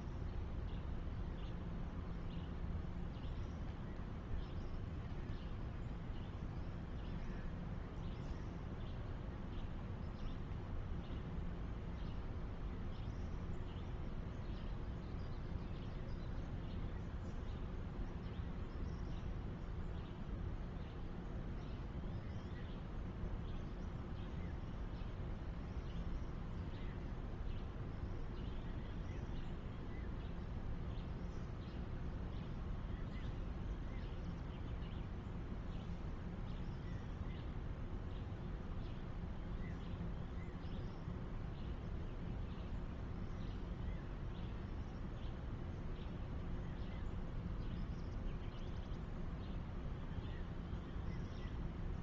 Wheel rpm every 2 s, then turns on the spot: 0, 0, 0, 0, 0, 0, 0, 0, 0, 0, 0, 0, 0, 0, 0, 0, 0, 0, 0, 0, 0, 0, 0, 0, 0, 0.
none